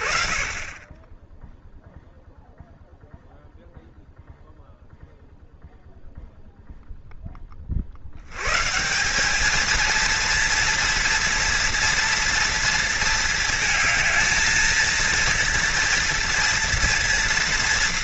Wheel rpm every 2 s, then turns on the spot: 20, 0, 0, 0, 110, 230, 230, 220, 230.
none